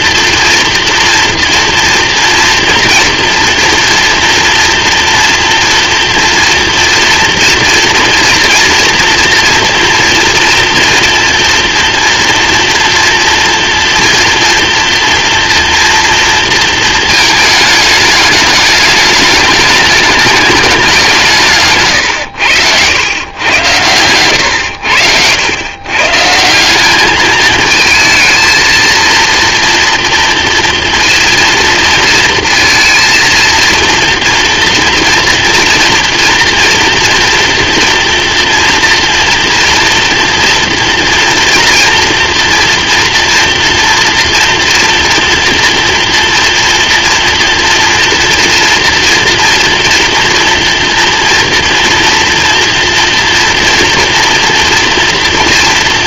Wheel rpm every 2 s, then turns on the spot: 230, 230, 240, 230, 230, 230, 230, 240, 230, 210, 200, 100, 90, 180, 220, 230, 230, 230, 230, 230, 230, 230, 230, 230, 230, 240, 240, 230.
none